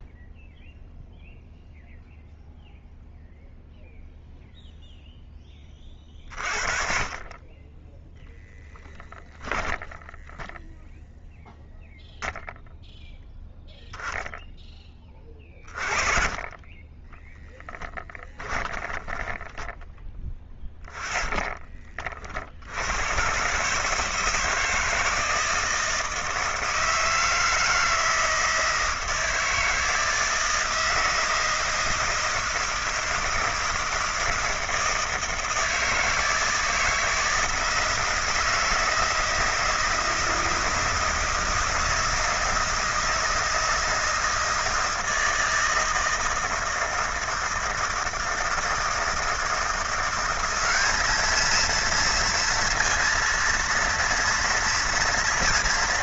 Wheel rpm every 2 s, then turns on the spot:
0, 0, 0, 40, 10, 10, 0, 0, 30, 10, 10, 50, 160, 160, 160, 160, 160, 160, 160, 160, 160, 160, 160, 160, 160, 190, 230, 230.
8-10 18-22